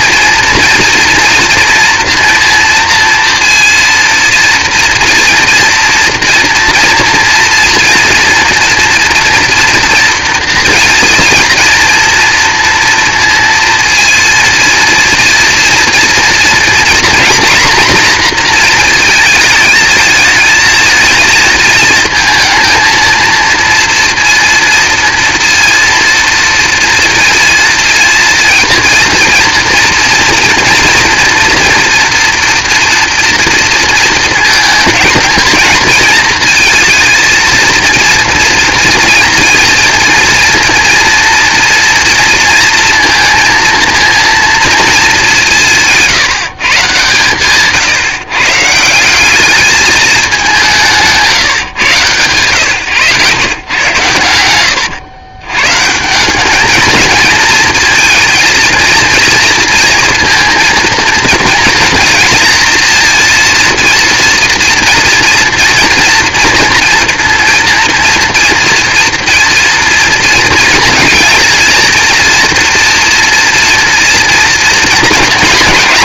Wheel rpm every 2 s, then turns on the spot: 230, 230, 240, 240, 230, 230, 230, 230, 240, 220, 220, 230, 230, 230, 230, 230, 230, 220, 230, 230, 240, 230, 210, 130, 180, 150, 120, 100, 230, 230, 230, 230, 230, 230, 230, 240, 230, 230.
none